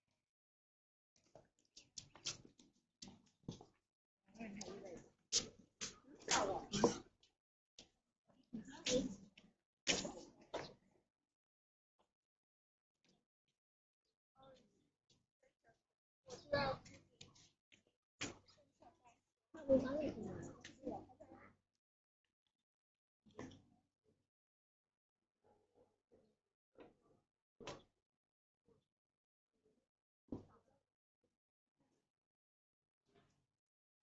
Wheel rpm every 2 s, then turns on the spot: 0, 0, 0, 0, 0, 0, 0, 0, 0, 0, 0, 0, 0, 0, 0, 0, 0.
none